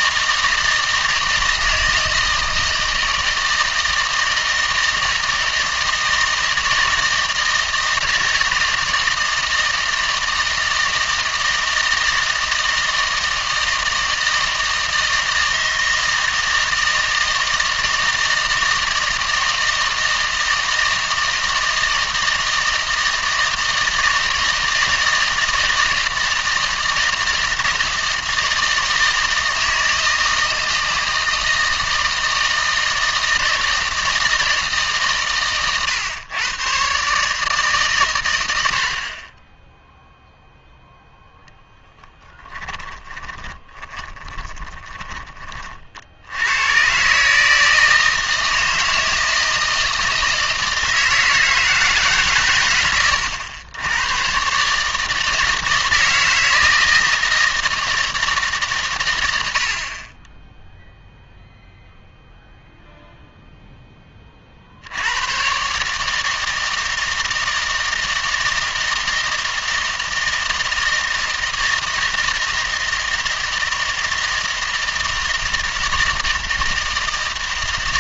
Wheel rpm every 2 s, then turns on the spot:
160, 160, 160, 160, 160, 160, 160, 160, 160, 160, 160, 160, 160, 160, 160, 160, 160, 150, 130, 80, 10, 20, 20, 120, 160, 160, 110, 150, 160, 130, 0, 0, 70, 160, 160, 160, 160, 160, 160.
42-46